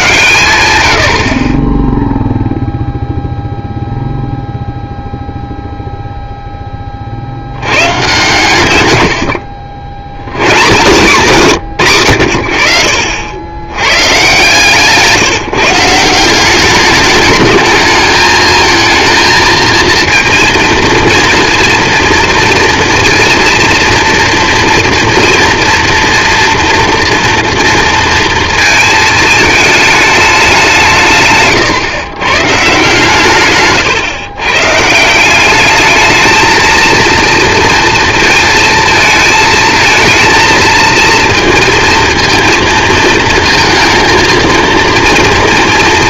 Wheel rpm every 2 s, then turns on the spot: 110, 0, 0, 10, 130, 140, 80, 140, 190, 220, 230, 230, 230, 240, 230, 190, 140, 130, 220, 220, 220, 230, 230.
none